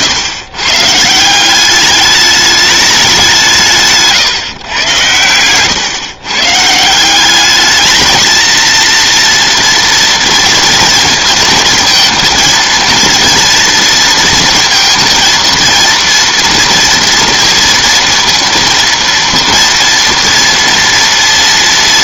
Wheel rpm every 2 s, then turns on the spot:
150, 210, 110, 160, 230, 230, 230, 230, 240, 230, 230.
none